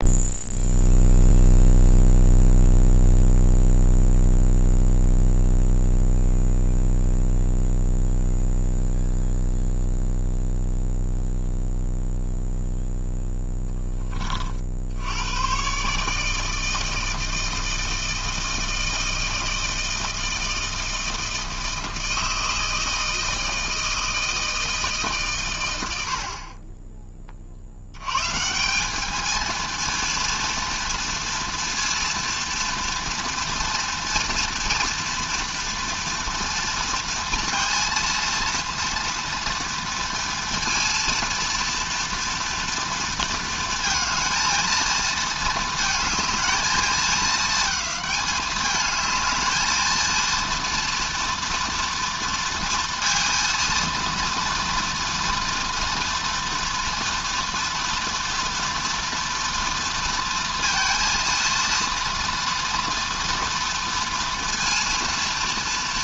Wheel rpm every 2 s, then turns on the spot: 0, 0, 0, 0, 0, 0, 0, 60, 160, 160, 160, 160, 160, 30, 190, 230, 230, 230, 230, 230, 230, 230, 230, 220, 210, 230, 230, 230, 230, 230, 230, 230, 230.
none